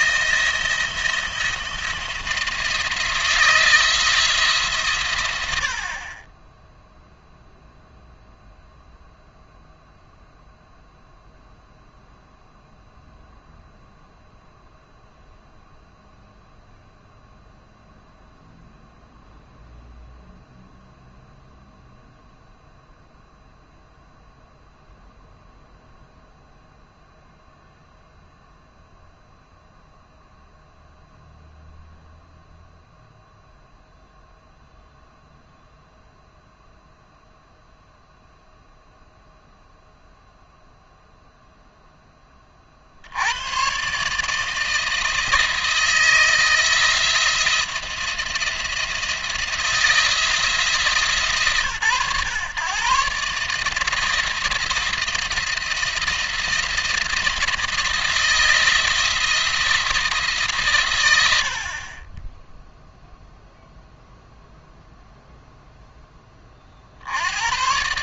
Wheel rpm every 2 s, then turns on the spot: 170, 170, 150, 10, 0, 0, 0, 0, 0, 0, 0, 0, 0, 0, 0, 0, 0, 0, 0, 0, 0, 40, 160, 170, 170, 150, 130, 170, 170, 170, 140, 0, 0, 40.
none